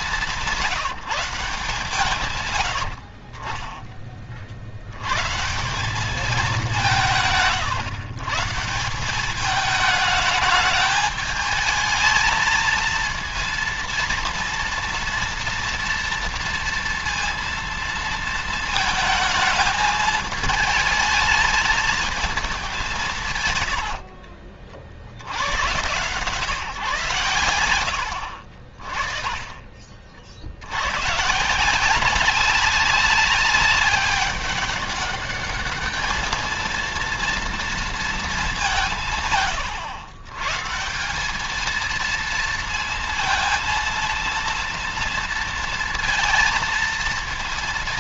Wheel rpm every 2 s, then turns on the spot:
160, 70, 100, 170, 170, 210, 230, 230, 230, 220, 220, 170, 70, 140, 40, 110, 200, 200, 230, 160, 170, 230, 230, 230.
none